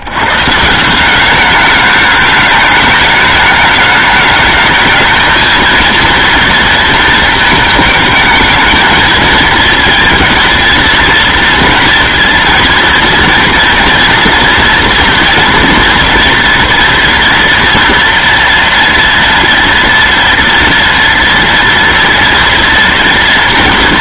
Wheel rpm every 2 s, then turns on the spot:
130, 210, 210, 230, 220, 230, 230, 230, 230, 230, 230, 240.
none